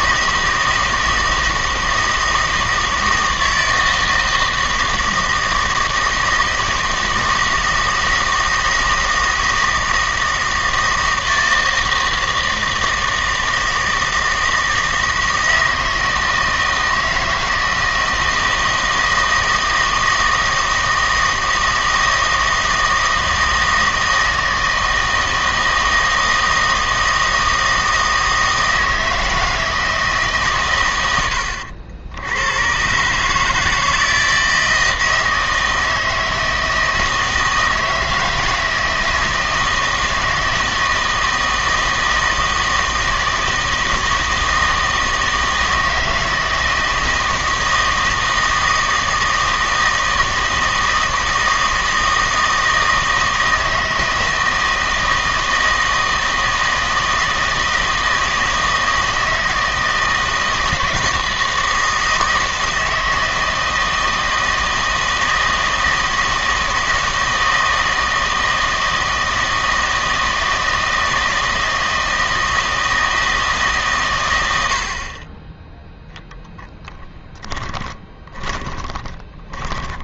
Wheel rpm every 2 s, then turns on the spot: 160, 160, 160, 160, 160, 160, 160, 160, 160, 160, 160, 160, 160, 160, 160, 110, 110, 160, 160, 160, 160, 160, 160, 160, 160, 160, 160, 160, 160, 160, 160, 160, 160, 160, 160, 160, 160, 70, 10, 20.
76-80